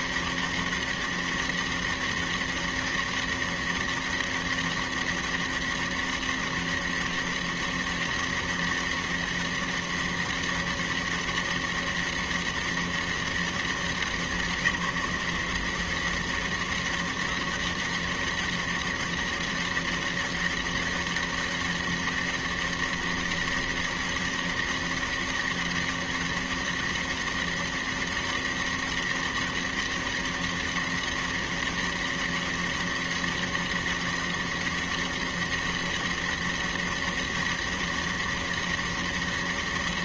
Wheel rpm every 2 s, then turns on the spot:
200, 200, 200, 200, 200, 200, 200, 180, 200, 200, 200, 200, 200, 200, 200, 200, 200, 200, 200, 200.
none